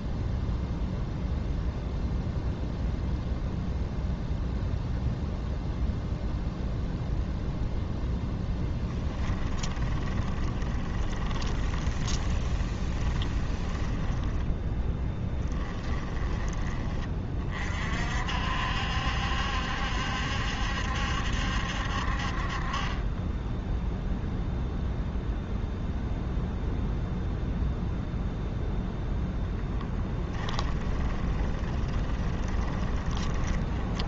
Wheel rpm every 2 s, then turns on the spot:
0, 0, 0, 0, 10, 20, 20, 10, 30, 70, 70, 20, 0, 0, 0, 10, 20.
8-16 30-34